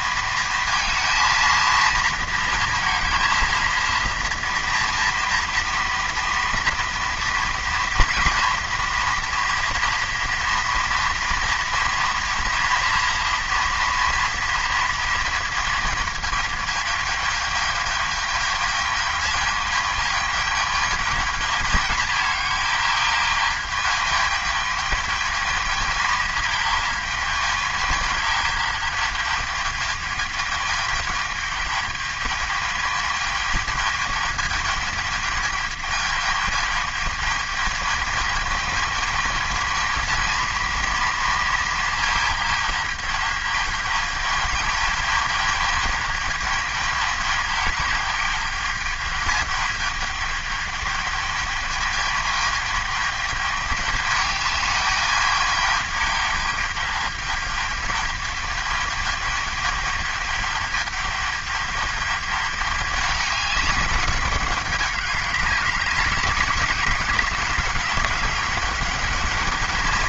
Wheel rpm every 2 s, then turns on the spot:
230, 230, 230, 240, 240, 230, 240, 230, 220, 220, 210, 220, 220, 220, 210, 210, 220, 210, 210, 220, 230, 210, 220, 210, 210, 210, 210, 210, 210, 210, 210, 210, 200, 200, 210.
none